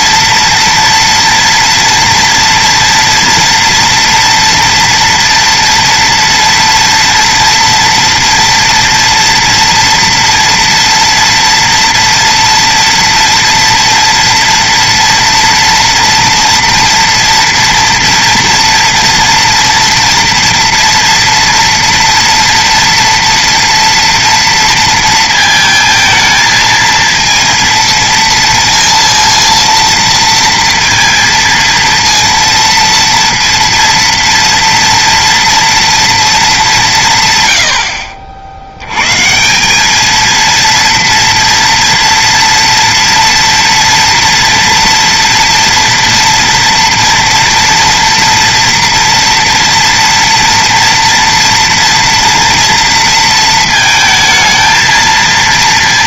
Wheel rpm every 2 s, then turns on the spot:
230, 230, 230, 230, 230, 230, 230, 230, 230, 230, 230, 230, 230, 220, 230, 230, 230, 230, 230, 70, 220, 230, 230, 230, 230, 230, 230, 230.
none